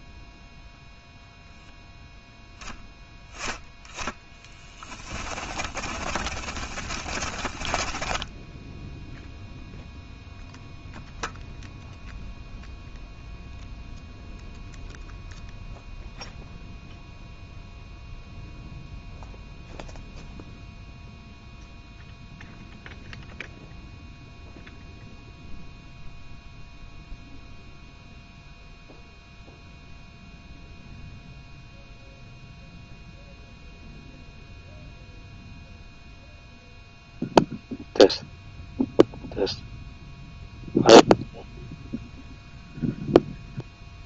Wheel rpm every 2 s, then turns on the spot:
0, 10, 20, 30, 0, 0, 0, 0, 0, 0, 0, 0, 0, 0, 0, 0, 0, 0, 0, 0, 0, 0.
2-8